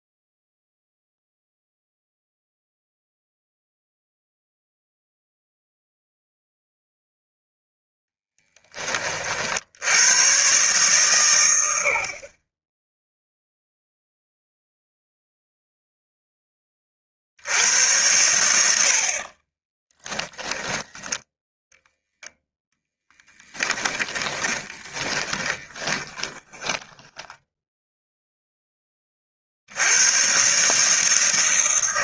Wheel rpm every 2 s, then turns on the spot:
0, 0, 0, 0, 20, 130, 30, 0, 20, 80, 10, 0, 20, 20, 10, 140.
20-22 24-28